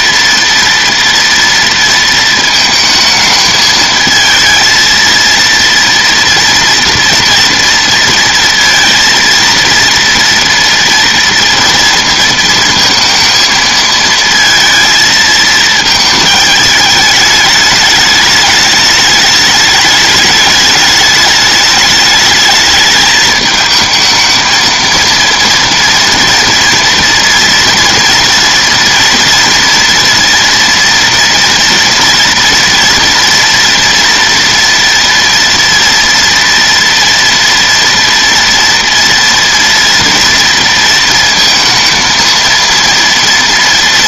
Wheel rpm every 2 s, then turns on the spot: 230, 220, 230, 230, 230, 230, 230, 230, 210, 210, 210, 210, 230, 230, 230, 230, 240, 230, 230, 230, 230, 230.
none